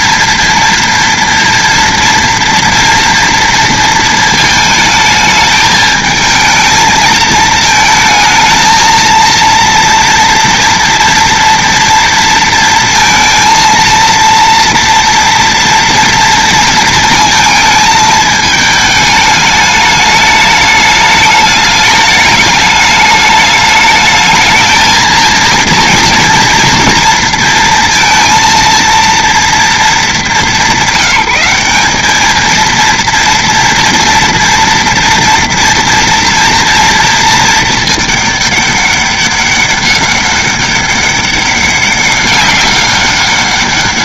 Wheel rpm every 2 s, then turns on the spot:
230, 230, 220, 220, 230, 230, 230, 230, 220, 210, 210, 210, 220, 230, 230, 200, 230, 230, 230, 200, 200, 190.
none